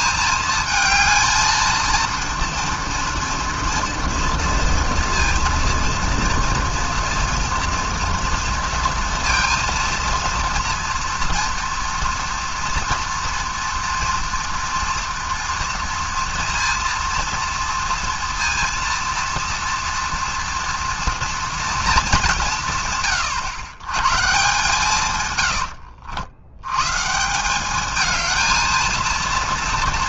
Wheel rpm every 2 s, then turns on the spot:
220, 230, 240, 230, 230, 230, 230, 230, 230, 230, 230, 150, 140, 120, 230.
none